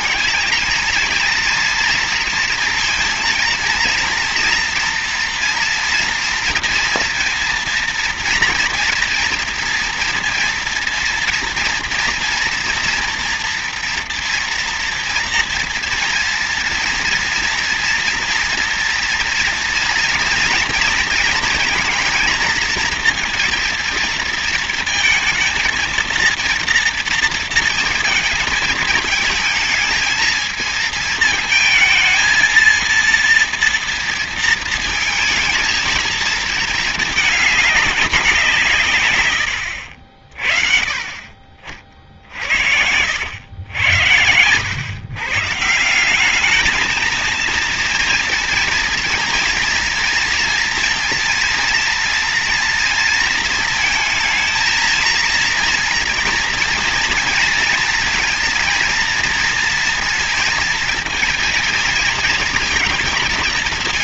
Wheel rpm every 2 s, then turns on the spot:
230, 230, 230, 240, 230, 240, 240, 230, 230, 240, 230, 230, 230, 230, 220, 220, 230, 230, 220, 190, 50, 60, 110, 200, 230, 230, 230, 220, 230, 230, 230, 230.
none